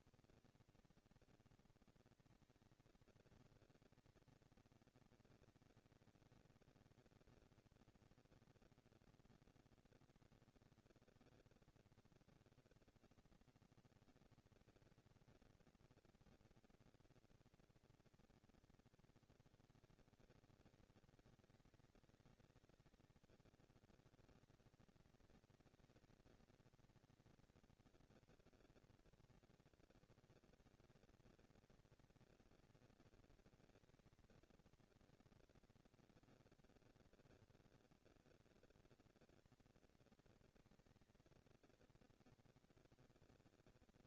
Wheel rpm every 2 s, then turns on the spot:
230, 220, 230, 230, 240, 230, 230, 230, 230, 200, 200, 200, 220, 230, 230, 230, 230, 230, 230, 230, 230, 230.
none